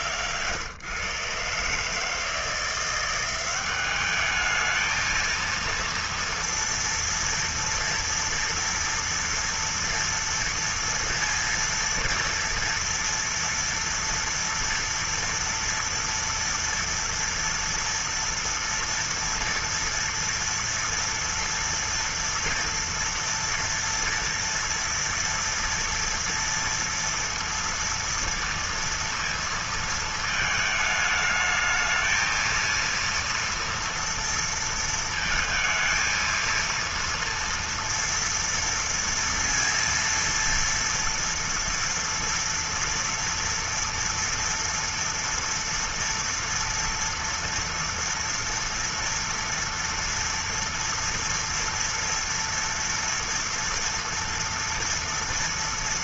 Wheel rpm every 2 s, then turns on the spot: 120, 150, 200, 230, 230, 230, 230, 230, 230, 240, 240, 230, 230, 230, 230, 230, 220, 230, 230, 230, 230, 230, 230, 230, 230, 230, 230, 230.
none